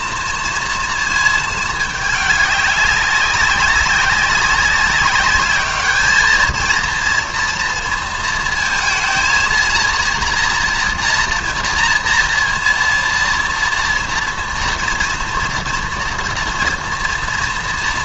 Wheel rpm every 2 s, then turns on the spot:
230, 200, 200, 230, 230, 230, 230, 230, 230.
none